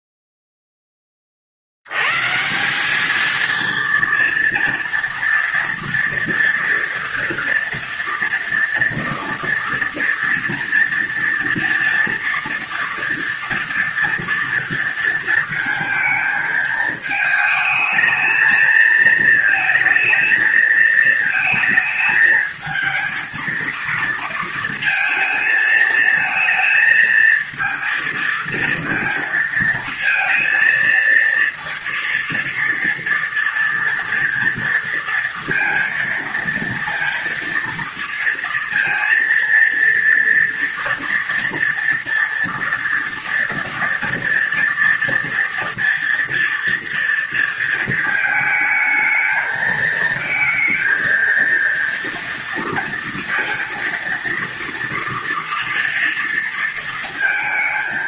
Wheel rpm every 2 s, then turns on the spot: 0, 170, 230, 230, 230, 230, 230, 230, 220, 220, 220, 220, 230, 230, 230, 230, 230, 230, 230, 230, 240, 230, 230, 230, 220, 220, 230, 230, 230.
none